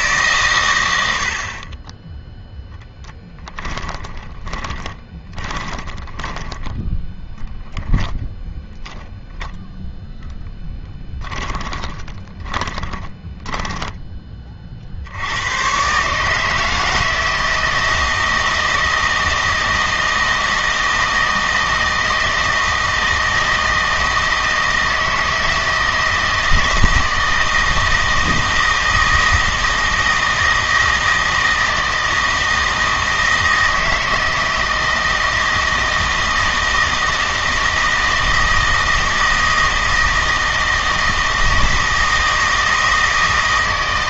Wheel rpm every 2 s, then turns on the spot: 110, 10, 20, 10, 10, 10, 20, 50, 160, 160, 160, 160, 160, 160, 160, 160, 160, 160, 160, 160, 160, 160.
4-8 10-14